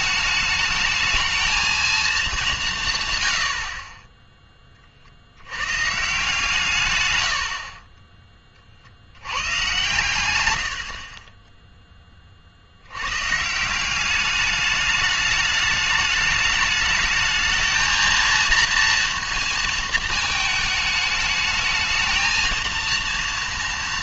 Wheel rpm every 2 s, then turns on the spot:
220, 170, 20, 130, 50, 90, 70, 210, 210, 230, 220, 230.
none